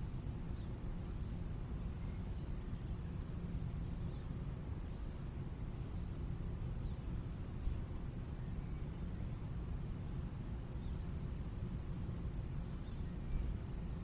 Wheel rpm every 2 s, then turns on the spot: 0, 0, 0, 0, 0, 0, 0.
none